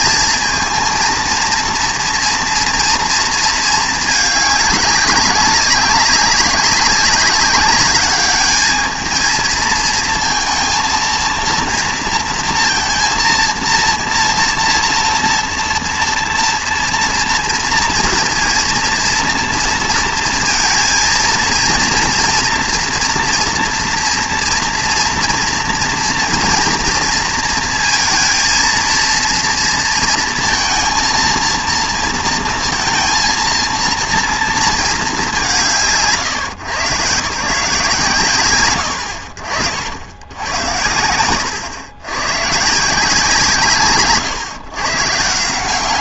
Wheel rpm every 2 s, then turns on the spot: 230, 230, 200, 200, 220, 230, 230, 230, 230, 230, 230, 230, 230, 230, 230, 230, 230, 230, 150, 50, 100, 170, 150.
none